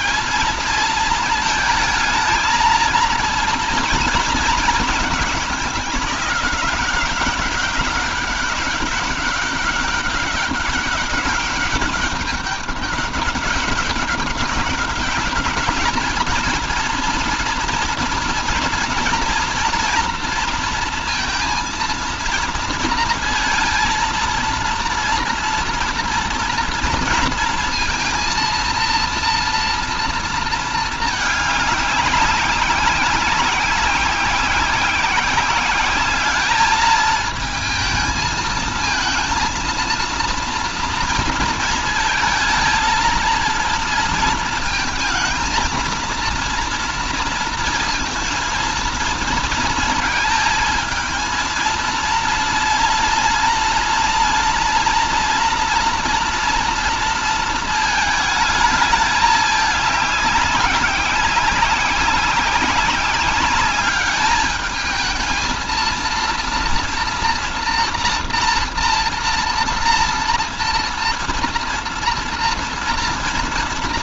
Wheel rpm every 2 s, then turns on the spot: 220, 230, 220, 190, 200, 200, 200, 190, 230, 230, 230, 230, 230, 230, 230, 220, 190, 190, 210, 220, 230, 230, 230, 230, 230, 230, 230, 230, 230, 210, 200, 190, 210, 230, 230, 230, 230.
none